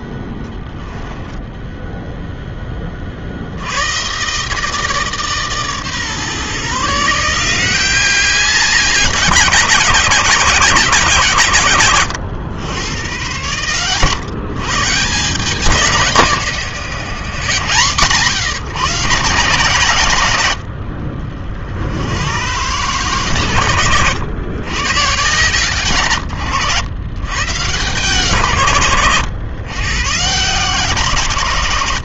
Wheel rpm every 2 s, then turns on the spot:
10, 20, 150, 150, 190, 170, 100, 150, 150, 150, 60, 140, 100, 120, 130, 140.
none